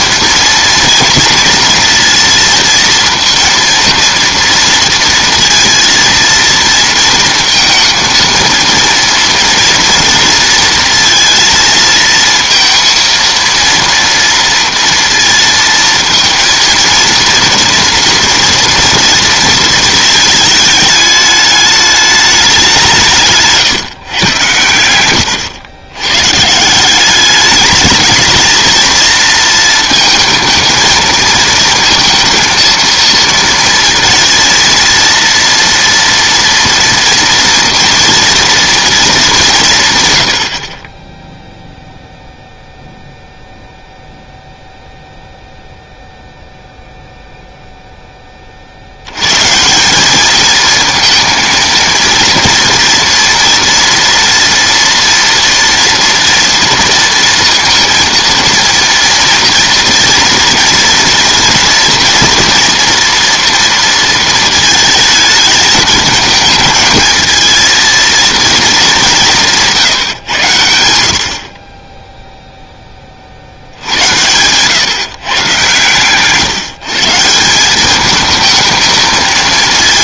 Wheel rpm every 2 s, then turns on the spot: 230, 230, 230, 230, 230, 230, 230, 230, 230, 230, 220, 200, 110, 150, 220, 220, 230, 230, 230, 230, 50, 0, 0, 0, 50, 220, 230, 230, 230, 230, 230, 230, 230, 220, 220, 100, 10, 120, 140, 220.
none